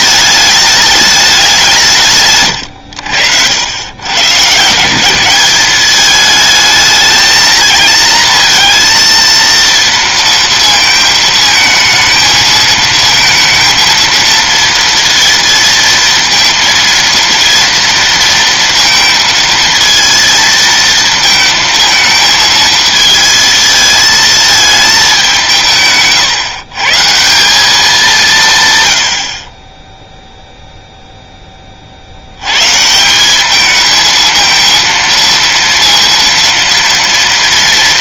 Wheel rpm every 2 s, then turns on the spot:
210, 110, 150, 220, 230, 230, 220, 230, 230, 230, 220, 220, 220, 130, 150, 0, 120, 230, 230.
none